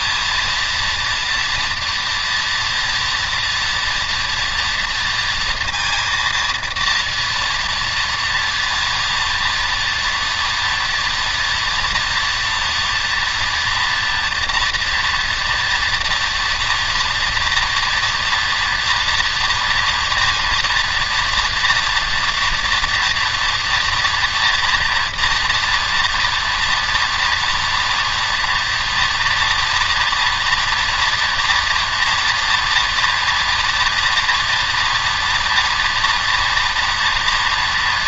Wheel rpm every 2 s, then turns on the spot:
230, 230, 230, 230, 230, 230, 230, 230, 230, 230, 230, 230, 230, 240, 230, 240, 230, 230, 230.
none